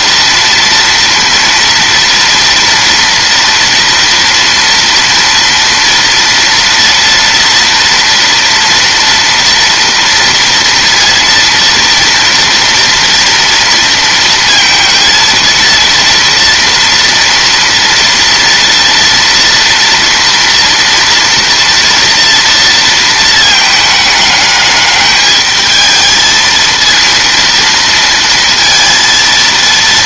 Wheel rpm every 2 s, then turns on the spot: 230, 230, 230, 230, 230, 230, 230, 230, 230, 230, 230, 230, 210, 230, 230.
none